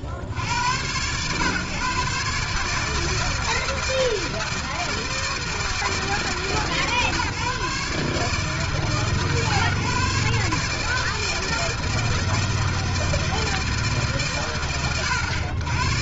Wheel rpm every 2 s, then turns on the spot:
60, 150, 160, 150, 140, 140, 160, 110.
none